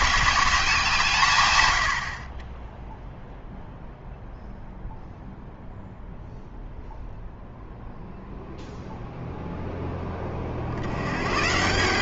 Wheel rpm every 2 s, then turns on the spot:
200, 30, 0, 0, 0, 40.
none